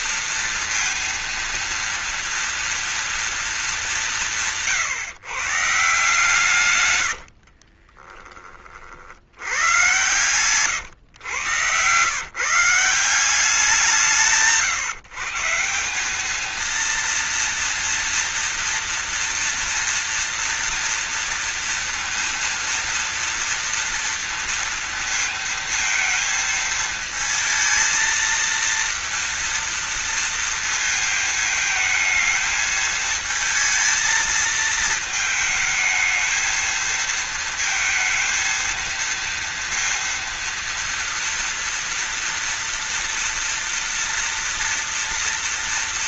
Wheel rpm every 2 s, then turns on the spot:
230, 230, 160, 150, 30, 130, 150, 150, 220, 230, 230, 230, 230, 220, 230, 230, 220, 220, 230, 230, 230, 230, 240.
10-12